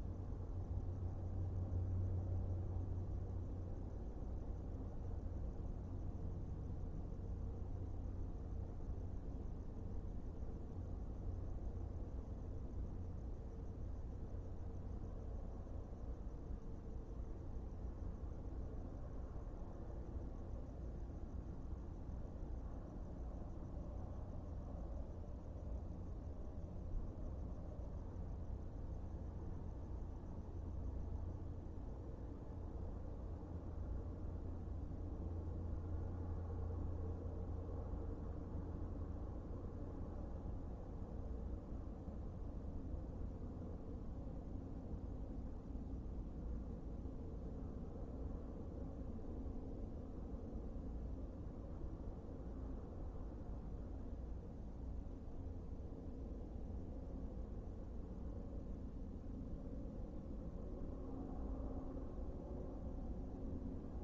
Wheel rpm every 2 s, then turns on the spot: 0, 0, 0, 0, 0, 0, 0, 0, 0, 0, 0, 0, 0, 0, 0, 0, 0, 0, 0, 0, 0, 0, 0, 0, 0, 0, 0, 0, 0, 0, 0, 0.
none